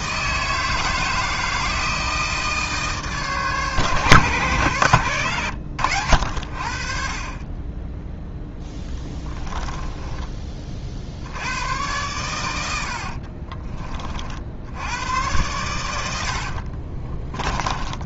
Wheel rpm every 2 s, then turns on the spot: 160, 150, 120, 50, 10, 30, 100, 80, 50.
8-10 16-18